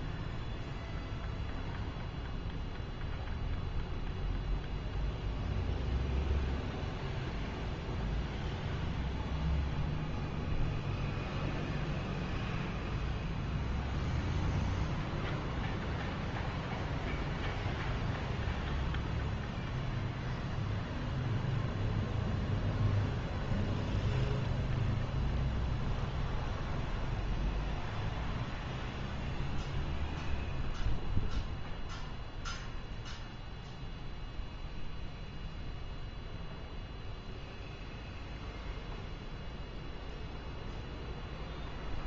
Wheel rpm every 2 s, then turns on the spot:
0, 0, 0, 0, 0, 0, 0, 0, 0, 0, 0, 0, 0, 0, 0, 0, 0, 0, 0, 0, 0.
none